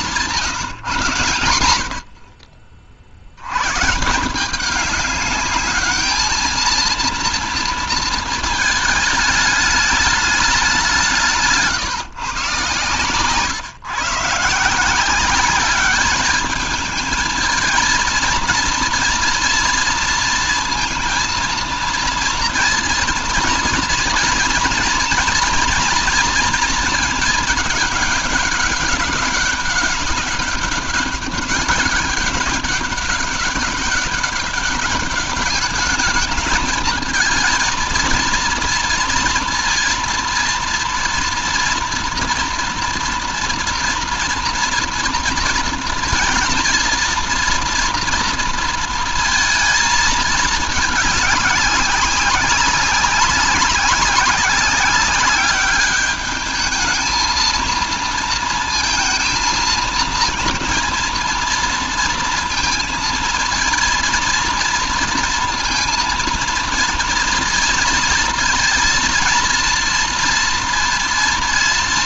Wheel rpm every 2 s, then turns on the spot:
120, 60, 200, 230, 220, 170, 120, 180, 220, 230, 230, 230, 230, 220, 200, 200, 190, 210, 220, 230, 230, 230, 230, 230, 230, 210, 190, 200, 220, 230, 230, 230, 230, 230, 230, 230.
none